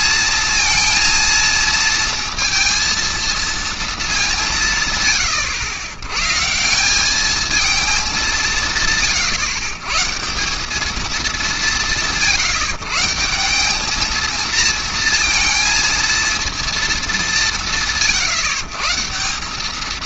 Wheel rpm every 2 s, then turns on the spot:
230, 230, 100, 220, 140, 200, 180, 230, 170, 180.
none